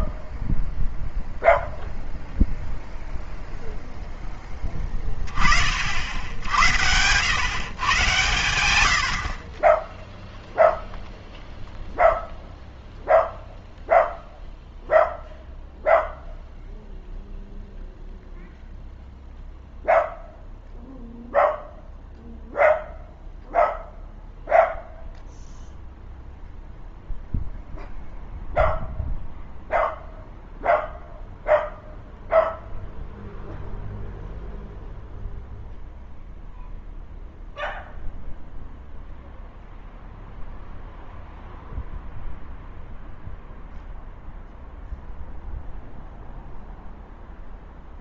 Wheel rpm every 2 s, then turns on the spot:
0, 0, 10, 100, 80, 0, 0, 0, 0, 0, 0, 0, 0, 0, 0, 0, 0, 0, 0, 0, 0, 0, 0, 0.
none